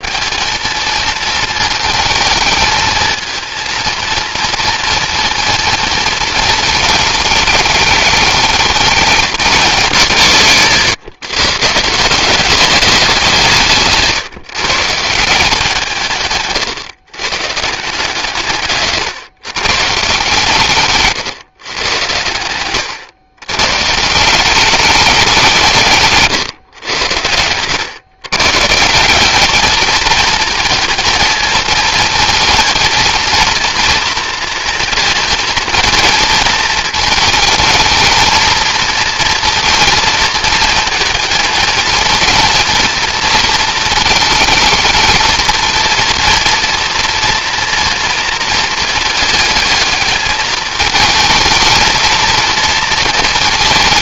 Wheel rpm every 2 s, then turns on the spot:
210, 220, 230, 220, 220, 130, 200, 150, 130, 140, 140, 100, 190, 130, 140, 230, 220, 230, 220, 230, 220, 230, 220, 230, 230, 220, 230.
16-18